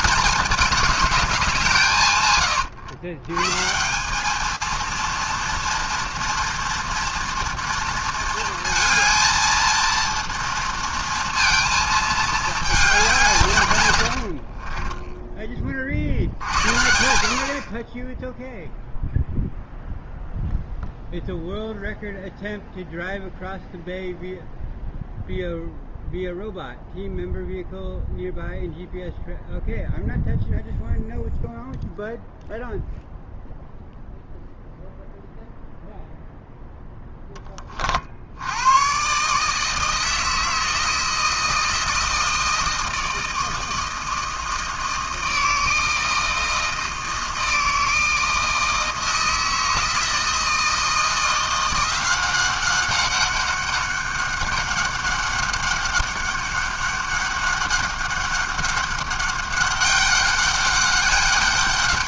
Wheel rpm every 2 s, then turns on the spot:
210, 110, 220, 240, 230, 230, 220, 40, 60, 0, 0, 0, 0, 0, 0, 0, 0, 0, 0, 90, 160, 160, 160, 160, 160, 160, 190, 200, 200, 200, 200.
14-16